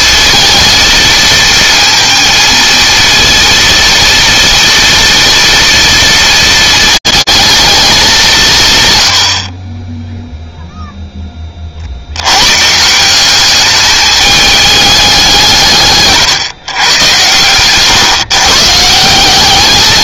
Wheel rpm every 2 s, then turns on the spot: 220, 230, 230, 220, 130, 0, 160, 210, 130, 160.
none